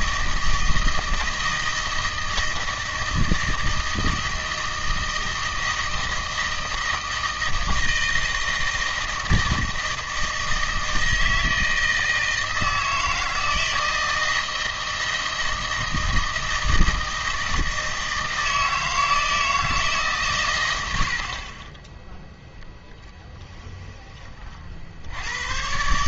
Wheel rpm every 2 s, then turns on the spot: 160, 160, 160, 160, 160, 160, 160, 160, 160, 160, 110, 0, 50.
none